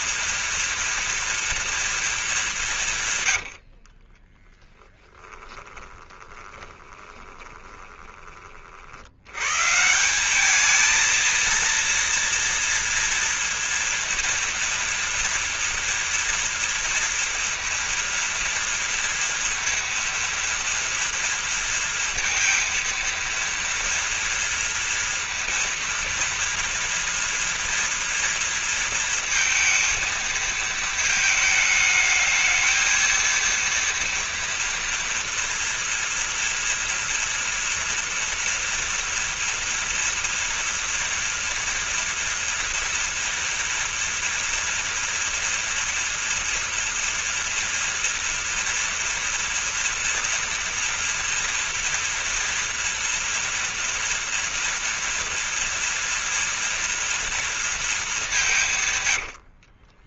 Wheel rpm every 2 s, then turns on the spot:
230, 150, 10, 20, 80, 220, 230, 240, 230, 230, 230, 230, 230, 230, 230, 220, 220, 230, 230, 230, 230, 230, 230, 230, 230, 230, 230, 230, 230, 140.
4-8 58-60